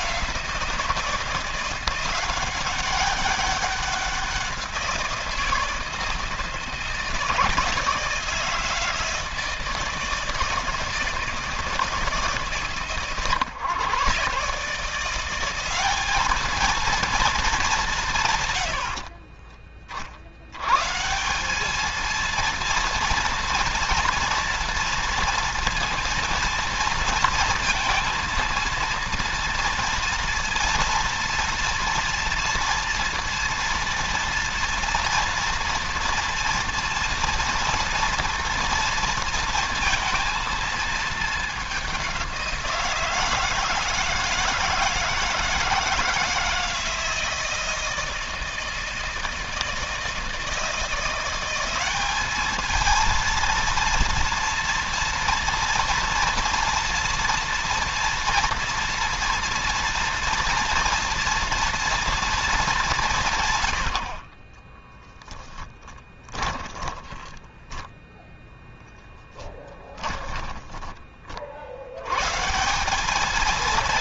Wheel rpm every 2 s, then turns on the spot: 170, 190, 180, 160, 160, 160, 140, 160, 220, 60, 130, 230, 230, 230, 230, 230, 230, 230, 240, 230, 220, 170, 160, 160, 160, 170, 220, 240, 230, 230, 230, 200, 10, 10, 10, 30, 180.
18-20 64-70